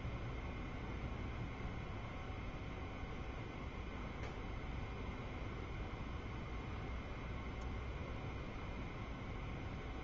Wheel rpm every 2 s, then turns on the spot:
0, 0, 0, 0, 0.
none